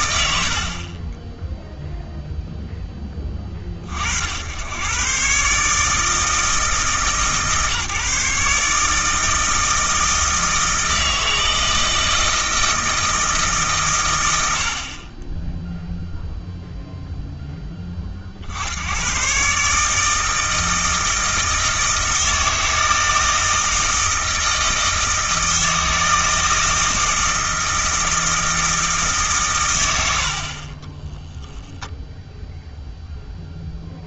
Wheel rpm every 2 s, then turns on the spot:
90, 10, 90, 160, 150, 160, 160, 90, 0, 70, 160, 160, 160, 160, 160, 40, 0.
30-32